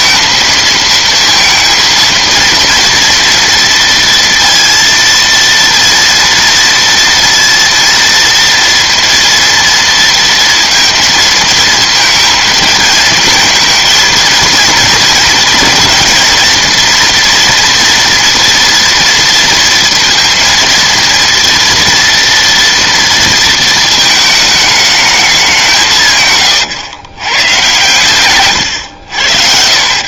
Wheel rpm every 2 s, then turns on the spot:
230, 230, 230, 230, 230, 230, 230, 230, 230, 240, 230, 230, 220, 130, 120.
26-28